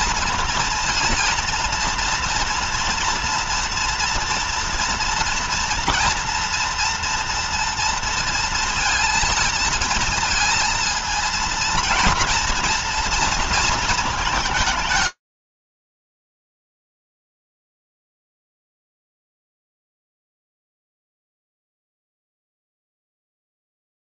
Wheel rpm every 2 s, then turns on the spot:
230, 230, 230, 230, 230, 230, 230, 220, 150, 0, 0, 0.
none